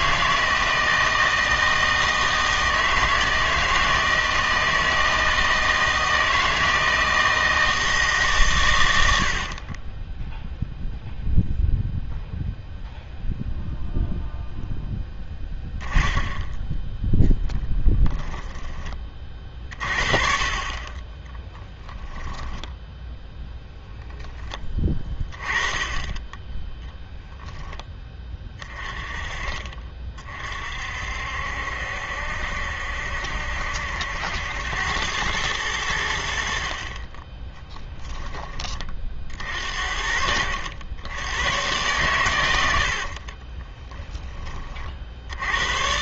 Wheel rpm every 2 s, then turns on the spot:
160, 160, 160, 160, 120, 0, 0, 0, 10, 20, 30, 0, 10, 20, 20, 50, 70, 90, 50, 30, 80, 80, 40.
18-20 26-28 36-38